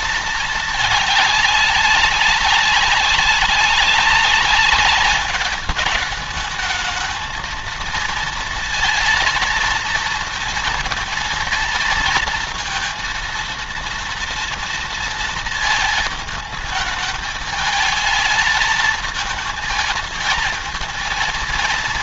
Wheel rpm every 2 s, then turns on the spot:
210, 200, 200, 220, 230, 230, 230, 230, 220, 220, 230.
none